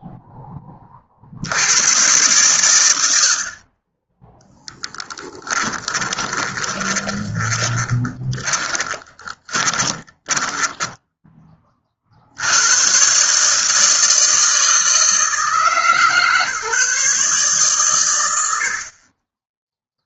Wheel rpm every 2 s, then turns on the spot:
10, 100, 0, 20, 20, 10, 90, 160, 150, 80.
6-12